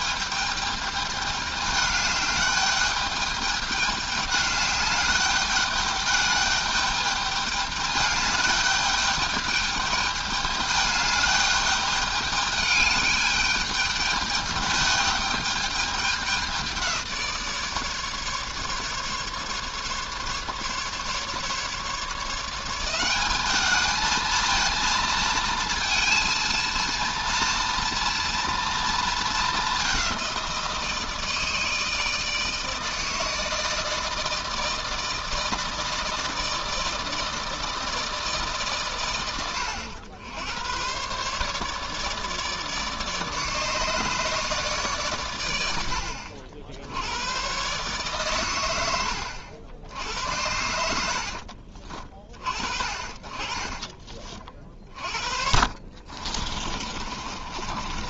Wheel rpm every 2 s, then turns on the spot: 210, 200, 210, 210, 200, 210, 210, 210, 190, 140, 150, 170, 220, 230, 230, 170, 160, 160, 160, 140, 110, 150, 150, 70, 110, 90, 40, 40, 40.
50-52 54-58